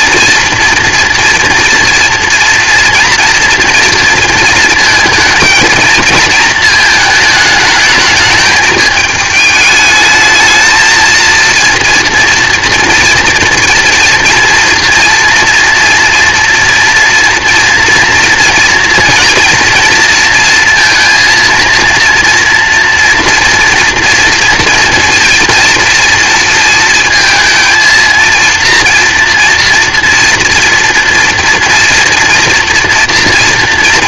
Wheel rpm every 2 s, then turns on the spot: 230, 230, 230, 230, 210, 220, 230, 230, 230, 230, 230, 240, 230, 220, 230, 230, 240.
none